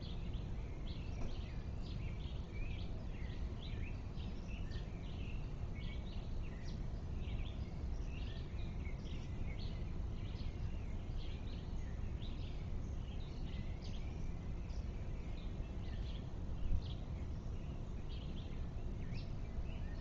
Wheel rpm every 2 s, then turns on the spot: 0, 0, 0, 0, 0, 0, 0, 0, 0, 0.
none